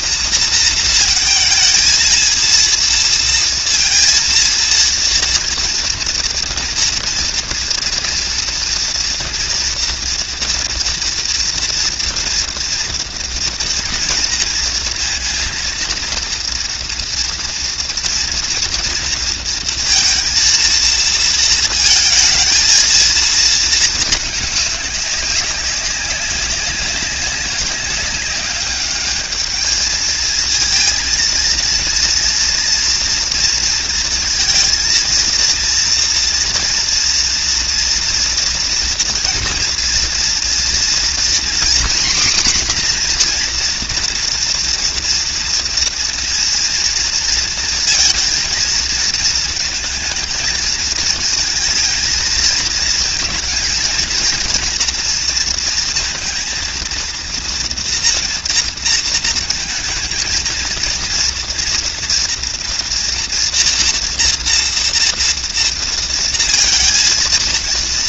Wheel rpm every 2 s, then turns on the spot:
230, 230, 230, 230, 230, 230, 240, 230, 230, 240, 230, 220, 220, 190, 200, 220, 230, 230, 230, 230, 240, 250, 240, 230, 220, 220, 220, 230, 230, 230, 230, 230, 230, 230.
none